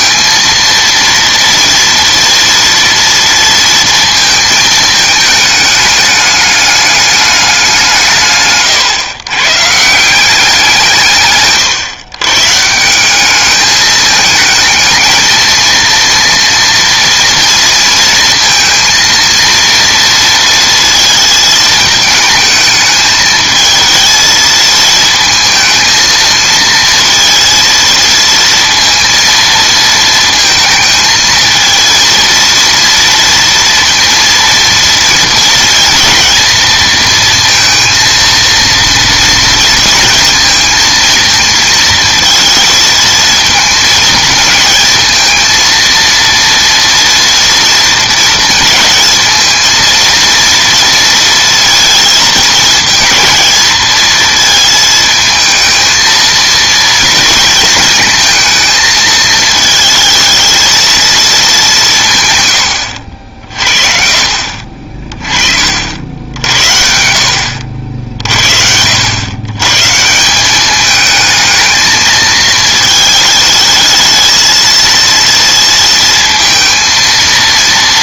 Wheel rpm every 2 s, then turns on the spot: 230, 240, 220, 210, 140, 170, 150, 220, 230, 230, 230, 210, 220, 230, 230, 230, 230, 230, 230, 230, 230, 220, 220, 230, 220, 230, 220, 220, 230, 220, 220, 100, 40, 70, 70, 200, 220, 220, 230.
none